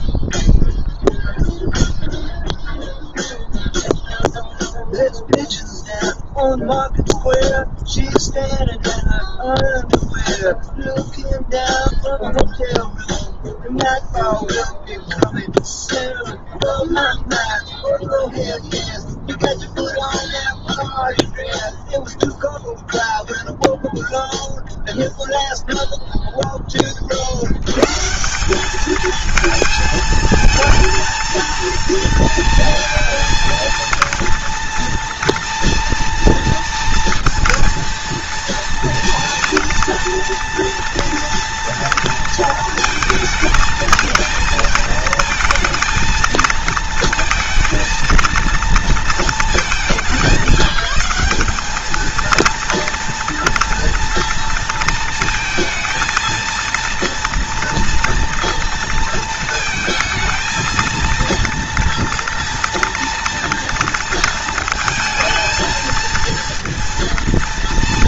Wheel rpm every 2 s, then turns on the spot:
0, 0, 0, 0, 0, 0, 0, 0, 0, 0, 0, 0, 0, 50, 220, 220, 230, 230, 230, 230, 230, 220, 230, 230, 220, 190, 230, 230, 230, 230, 230, 230, 220, 230.
none